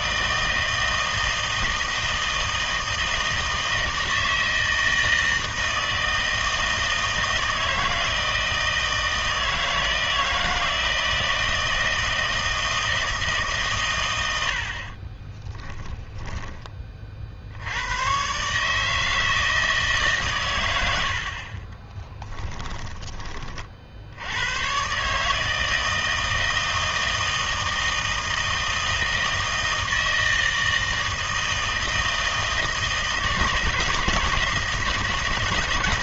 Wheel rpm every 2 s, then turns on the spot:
160, 160, 160, 160, 160, 160, 160, 70, 30, 150, 110, 10, 120, 160, 160, 160, 160, 160.
22-24